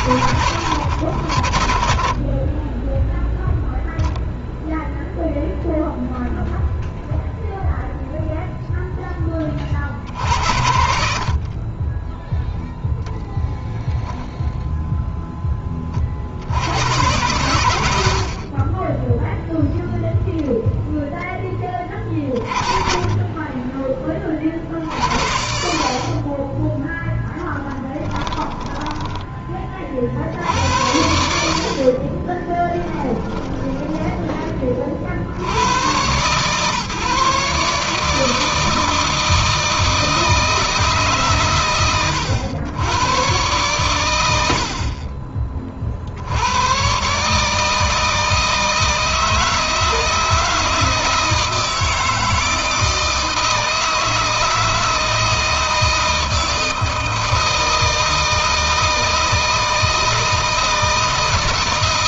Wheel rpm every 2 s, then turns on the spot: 70, 10, 0, 0, 10, 60, 0, 0, 90, 10, 0, 30, 50, 10, 10, 90, 10, 40, 140, 160, 150, 120, 50, 120, 160, 160, 160, 160, 160, 160, 160.
32-34